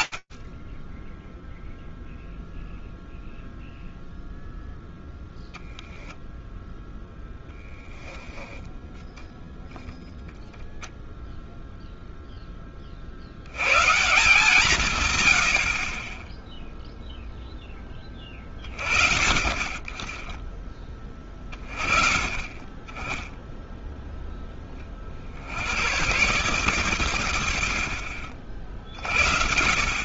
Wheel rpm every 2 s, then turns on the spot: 60, 0, 0, 0, 0, 0, 60, 90, 0, 40, 20, 10, 50, 110, 40.
none